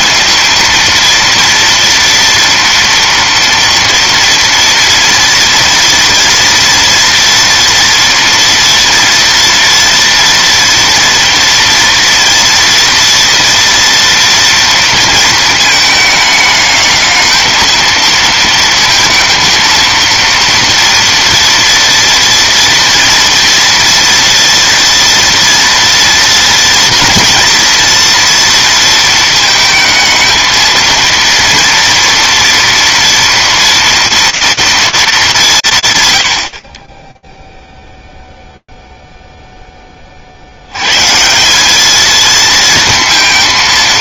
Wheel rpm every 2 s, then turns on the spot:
230, 230, 240, 230, 230, 230, 230, 230, 210, 220, 230, 230, 230, 230, 230, 220, 230, 230, 70, 0, 130, 230.
none